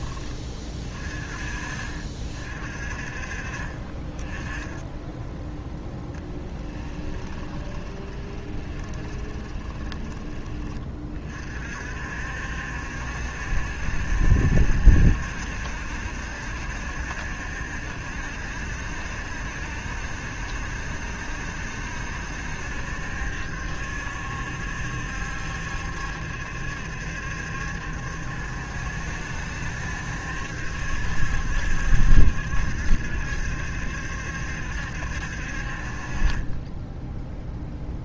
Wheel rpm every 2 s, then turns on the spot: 30, 50, 10, 10, 20, 30, 70, 70, 70, 70, 70, 70, 70, 70, 70, 70, 70, 70, 10.
6-10 36-38